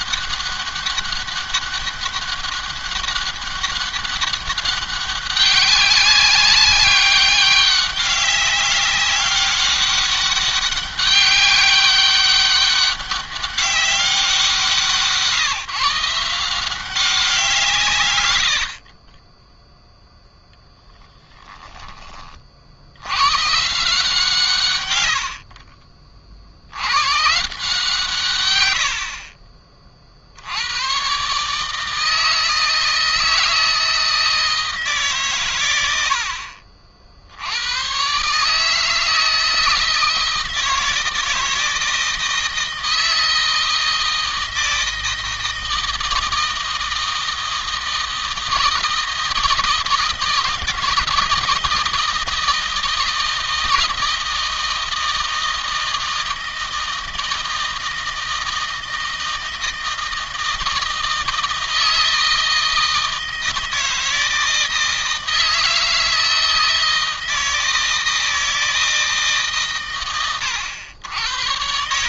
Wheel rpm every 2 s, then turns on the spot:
200, 200, 200, 200, 200, 200, 200, 170, 170, 70, 10, 50, 120, 80, 110, 90, 160, 160, 50, 150, 160, 160, 160, 160, 160, 160, 170, 160, 160, 160, 160, 160, 160, 160, 160, 100.
none